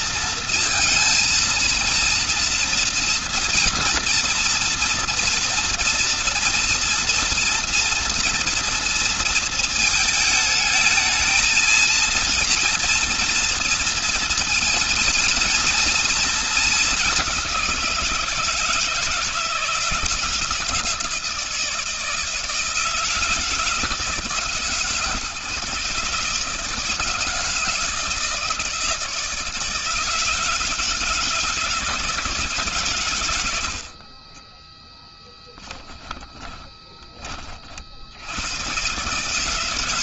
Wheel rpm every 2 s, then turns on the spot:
220, 240, 230, 230, 230, 220, 230, 230, 200, 160, 170, 170, 150, 160, 160, 150, 110, 10, 30, 140.
34-36